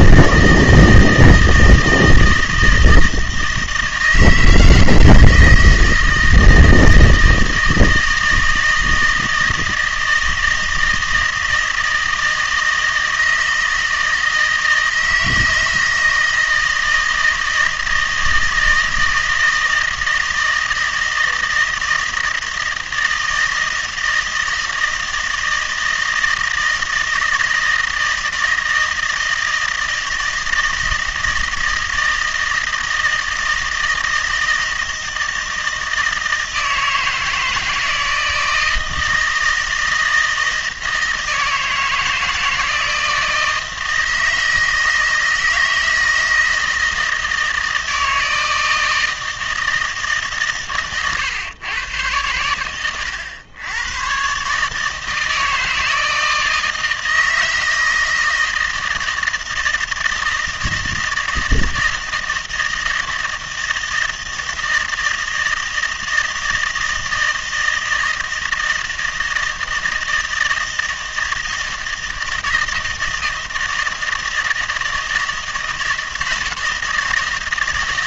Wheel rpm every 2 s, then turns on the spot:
160, 160, 160, 160, 160, 160, 160, 160, 160, 160, 160, 160, 160, 160, 160, 160, 160, 160, 160, 160, 160, 160, 160, 160, 160, 130, 110, 150, 160, 160, 160, 160, 160, 160, 160, 160, 160, 160, 160.
none